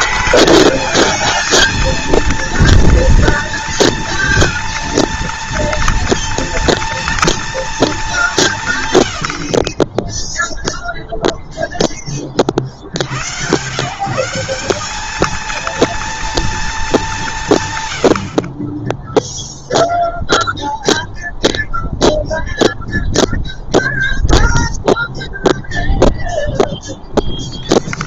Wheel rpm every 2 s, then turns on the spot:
220, 230, 230, 230, 120, 0, 80, 200, 200, 10, 0, 0, 0, 0.
none